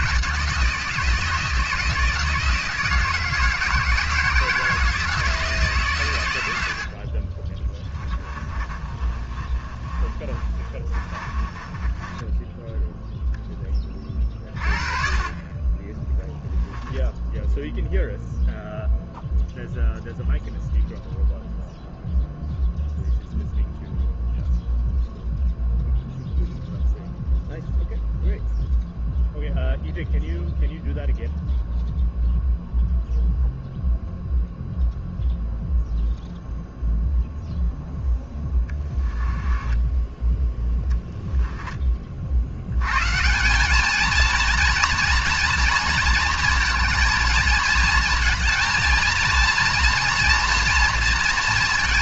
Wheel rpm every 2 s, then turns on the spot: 160, 160, 160, 90, 30, 30, 10, 40, 0, 0, 0, 0, 0, 0, 0, 0, 0, 0, 0, 10, 10, 90, 230, 230, 230, 230.
8-14 38-40